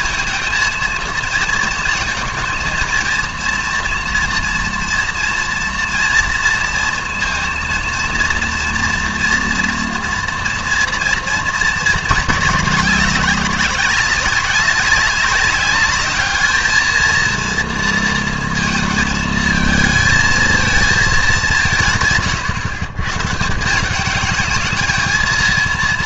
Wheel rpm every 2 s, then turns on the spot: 230, 230, 230, 230, 230, 230, 210, 190, 220, 230, 220, 130, 220.
none